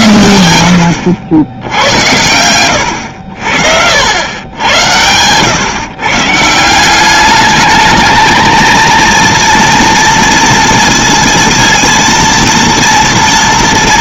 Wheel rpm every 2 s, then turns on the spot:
90, 100, 100, 160, 230, 230, 230.
none